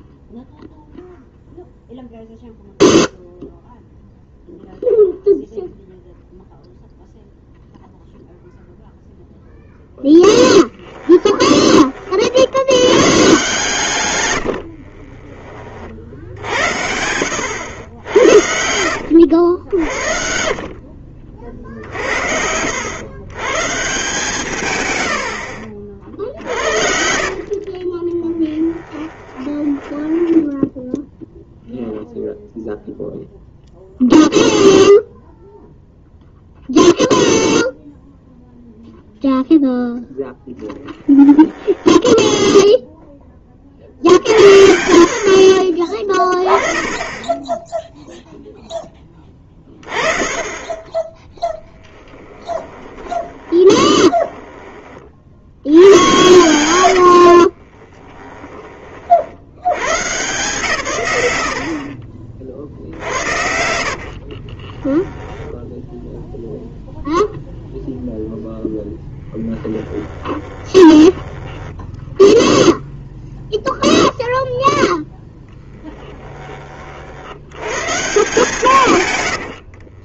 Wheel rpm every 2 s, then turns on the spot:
0, 0, 0, 0, 0, 10, 80, 80, 70, 80, 60, 80, 140, 50, 10, 0, 0, 0, 0, 0, 0, 0, 60, 20, 10, 10, 10, 20, 100, 20, 150, 60, 20, 0, 0, 10, 0, 0, 30, 150.
10-12 14-16 18-20 26-30 52-54 56-58 64-66 70-72